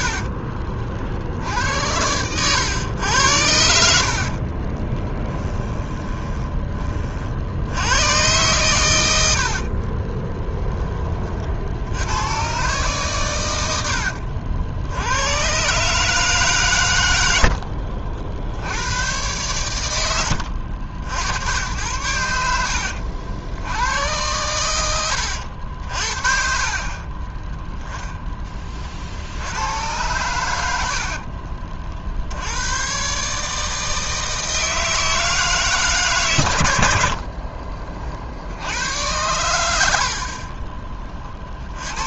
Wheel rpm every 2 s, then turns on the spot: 50, 110, 30, 20, 110, 10, 120, 70, 120, 80, 70, 70, 90, 40, 30, 90, 120, 160, 100, 90, 30.
4-6 22-26 40-42